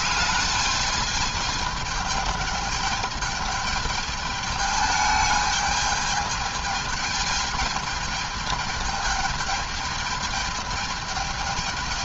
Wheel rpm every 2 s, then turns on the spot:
210, 210, 210, 210, 210, 210.
none